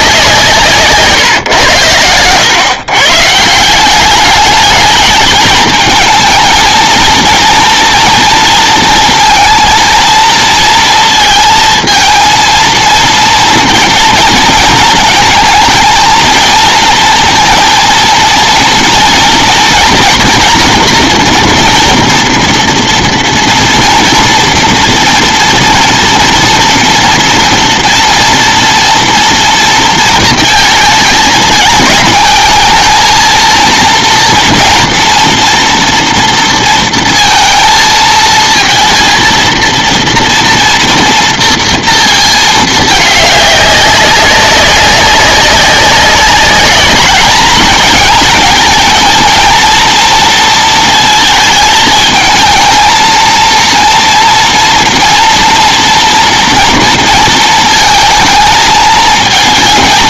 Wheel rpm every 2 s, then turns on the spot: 160, 110, 210, 220, 230, 230, 230, 230, 230, 230, 240, 240, 240, 230, 230, 220, 220, 230, 230, 230, 230, 220, 190, 200, 220, 230, 220, 230, 230, 220.
none